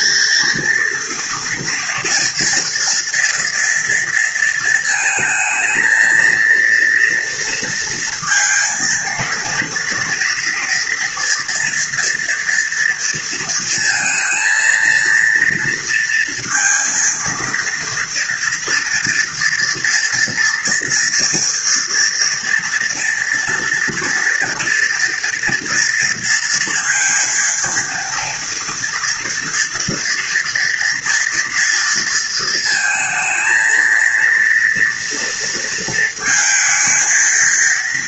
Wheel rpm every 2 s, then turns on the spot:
230, 240, 230, 230, 230, 230, 230, 230, 230, 230, 230, 230, 230, 230, 230, 230, 230, 230, 230.
none